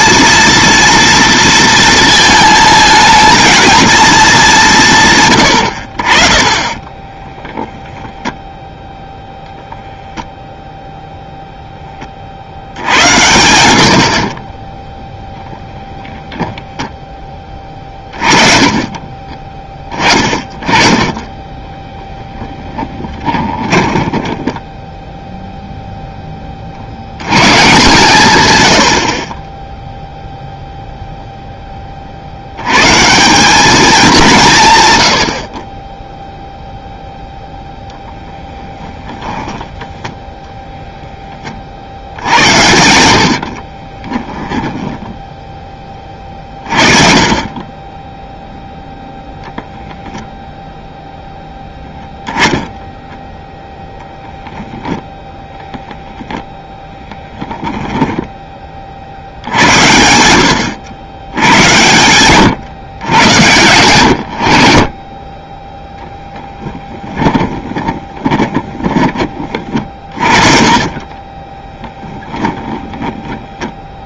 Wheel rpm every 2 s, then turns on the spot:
230, 220, 160, 30, 0, 0, 90, 30, 0, 30, 30, 10, 10, 30, 90, 0, 100, 140, 0, 10, 0, 70, 10, 40, 0, 0, 10, 0, 0, 30, 80, 130, 70, 20, 30, 40, 10.
14-16 22-26 38-40 42-46 66-72